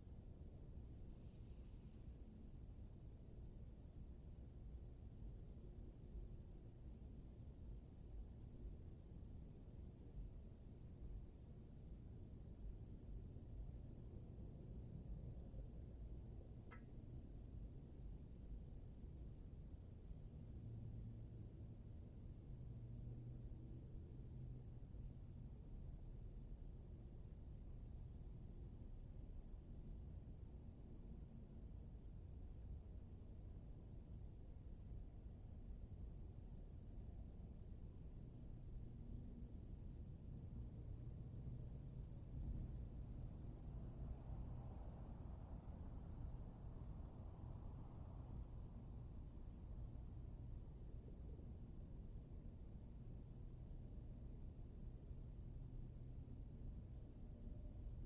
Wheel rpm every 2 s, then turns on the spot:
0, 0, 0, 0, 0, 0, 0, 0, 0, 0, 0, 0, 0, 0, 0, 0, 0, 0, 0, 0, 0, 0, 0, 0, 0, 0, 0, 0, 0.
none